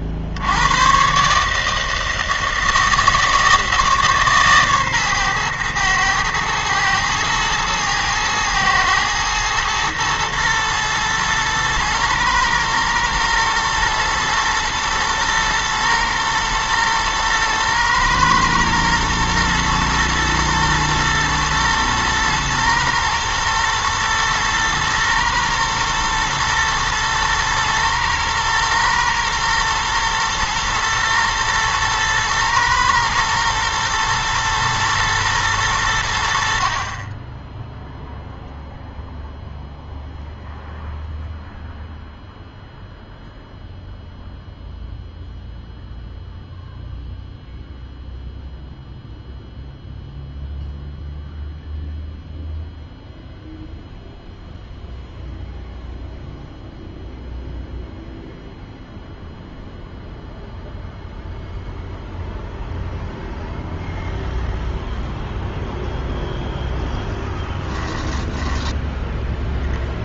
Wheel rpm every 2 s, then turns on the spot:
110, 160, 140, 120, 120, 110, 110, 110, 110, 110, 110, 110, 110, 110, 110, 120, 110, 120, 40, 0, 0, 0, 0, 0, 0, 0, 0, 0, 0, 0, 0, 0, 0, 0, 10.
none